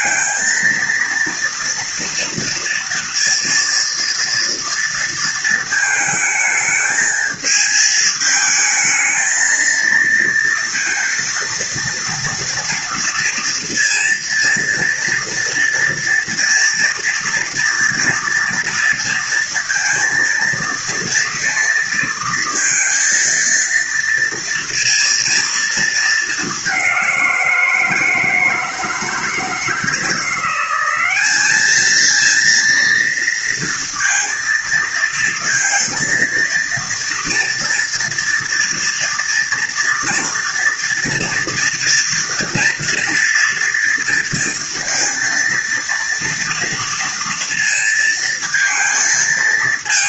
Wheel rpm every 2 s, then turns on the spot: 230, 230, 230, 220, 220, 230, 230, 230, 230, 230, 230, 230, 230, 210, 160, 180, 230, 230, 230, 230, 240, 230, 230, 230, 230.
none